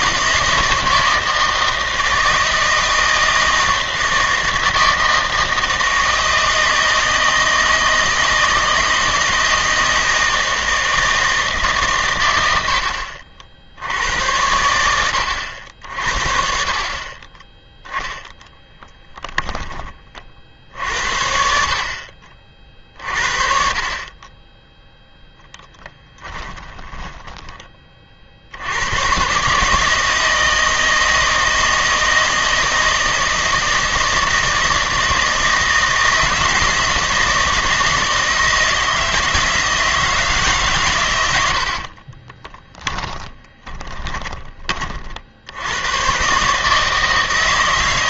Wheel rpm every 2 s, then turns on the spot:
160, 160, 160, 160, 160, 160, 80, 80, 40, 10, 60, 40, 10, 10, 80, 160, 160, 160, 160, 160, 140, 10, 30, 150.
18-20 26-28 42-44